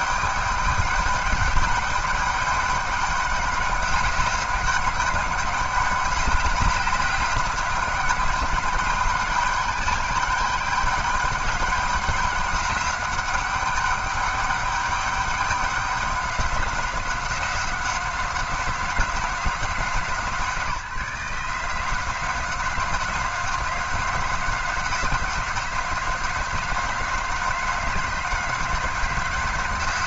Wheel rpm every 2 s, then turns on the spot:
200, 200, 200, 200, 210, 200, 200, 200, 190, 190, 170, 190, 180, 190, 190.
none